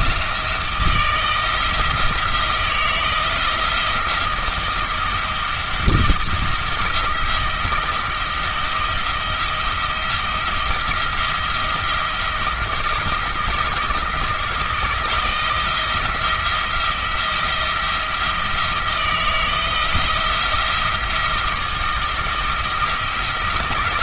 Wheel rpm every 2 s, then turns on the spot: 160, 170, 170, 170, 170, 170, 170, 170, 170, 170, 170, 170.
none